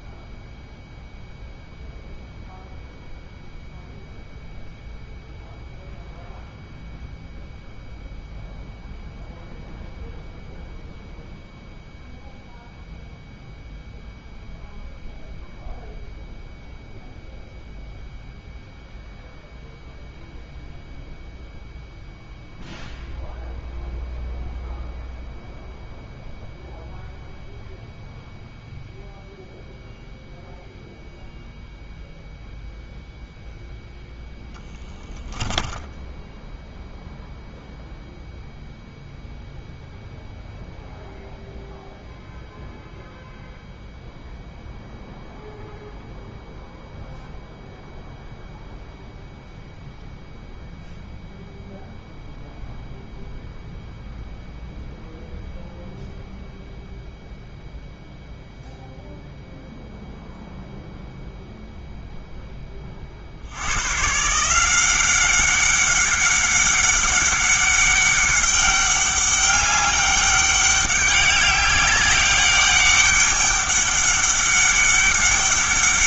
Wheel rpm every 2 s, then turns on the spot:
0, 0, 0, 0, 0, 0, 0, 0, 0, 0, 0, 0, 0, 0, 0, 0, 0, 10, 0, 0, 0, 0, 0, 0, 0, 0, 0, 0, 0, 0, 0, 20, 180, 200, 200, 200, 200, 200.
none